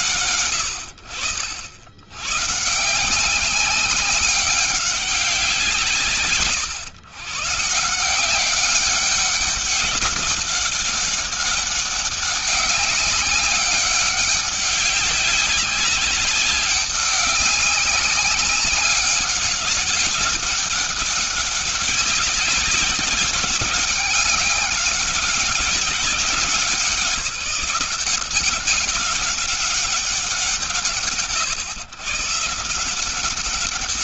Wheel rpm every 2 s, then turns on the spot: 50, 190, 140, 180, 190, 200, 200, 200, 200, 200, 200, 200, 190, 180, 200, 130, 200.
none